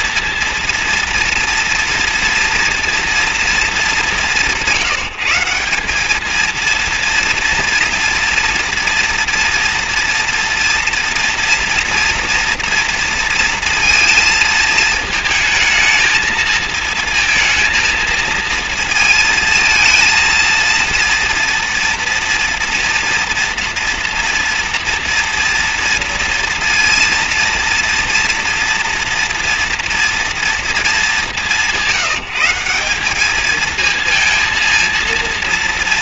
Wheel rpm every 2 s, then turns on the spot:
230, 230, 170, 220, 230, 230, 230, 230, 220, 230, 230, 230, 240, 230, 230, 230, 180, 230.
none